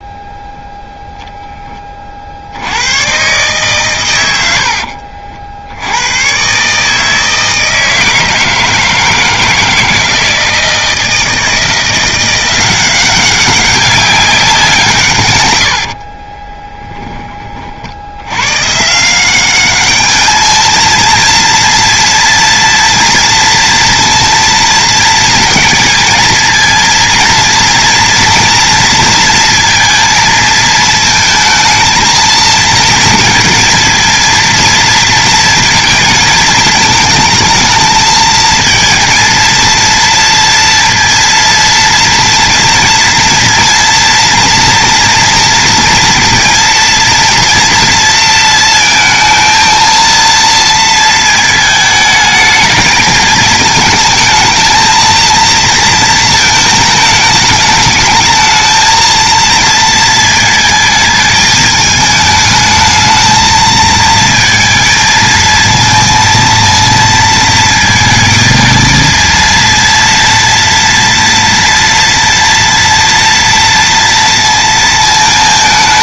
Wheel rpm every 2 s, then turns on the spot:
0, 110, 60, 150, 160, 160, 190, 160, 10, 150, 220, 230, 230, 230, 240, 230, 230, 230, 220, 220, 230, 230, 240, 230, 230, 220, 220, 230, 220, 220, 220, 220, 220, 230, 230, 230, 230, 220.
none